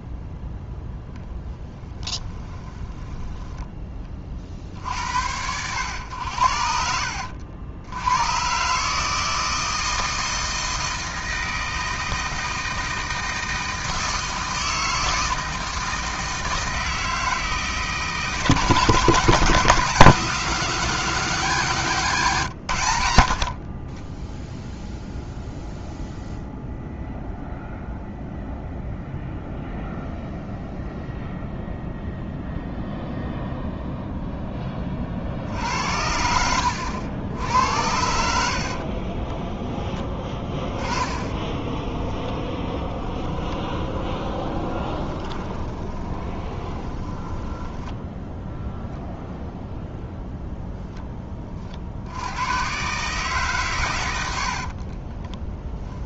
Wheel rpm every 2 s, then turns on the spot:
10, 10, 60, 80, 150, 160, 160, 160, 160, 150, 170, 90, 0, 0, 0, 0, 0, 30, 80, 50, 20, 20, 20, 10, 0, 10, 130, 40.
2-4 38-40 42-48 54-56